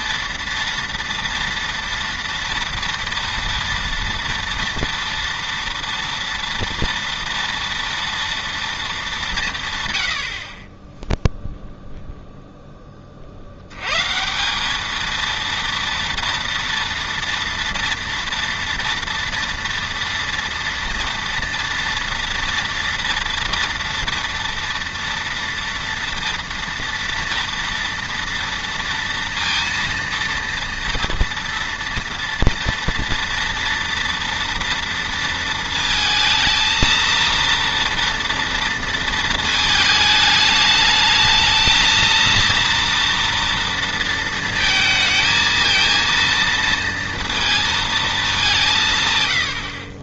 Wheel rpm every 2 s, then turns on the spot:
230, 230, 230, 230, 230, 20, 10, 190, 230, 230, 230, 230, 230, 230, 230, 230, 230, 230, 230, 230, 210, 230, 230, 230, 170.
none